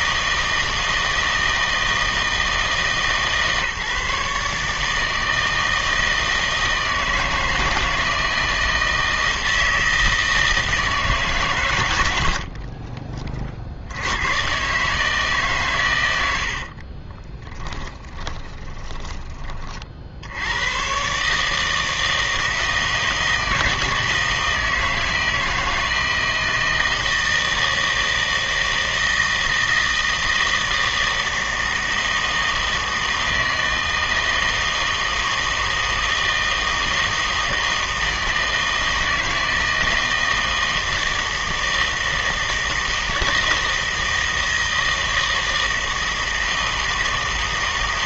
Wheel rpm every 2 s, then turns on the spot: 160, 160, 150, 160, 160, 160, 60, 130, 60, 20, 100, 160, 160, 160, 160, 160, 160, 160, 160, 160, 160, 160, 160, 160.
12-14 16-20